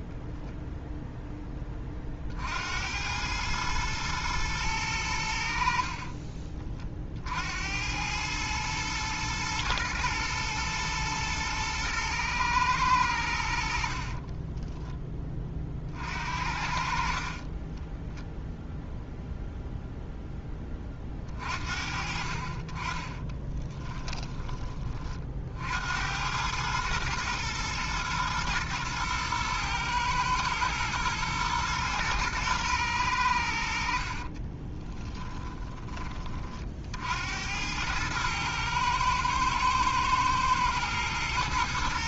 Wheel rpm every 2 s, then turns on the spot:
0, 80, 100, 50, 110, 120, 100, 10, 50, 0, 30, 30, 30, 110, 120, 110, 110, 20, 70, 110, 110.
34-36